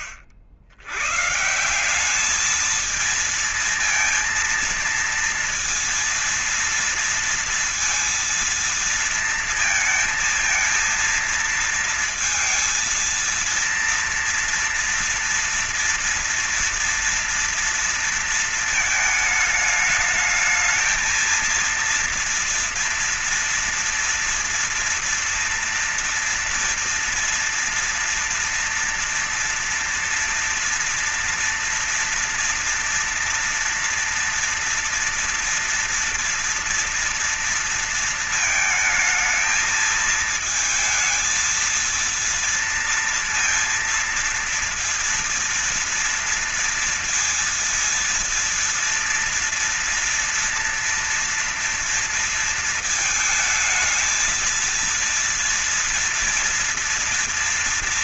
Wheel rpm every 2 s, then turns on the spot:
80, 220, 230, 230, 230, 230, 230, 230, 230, 220, 220, 230, 240, 230, 230, 230, 230, 230, 240, 220, 220, 230, 230, 230, 230, 230, 220, 230, 230.
none